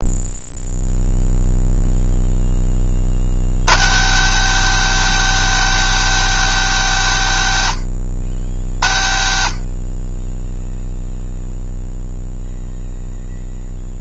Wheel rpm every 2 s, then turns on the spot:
0, 20, 200, 190, 70, 0, 0.
none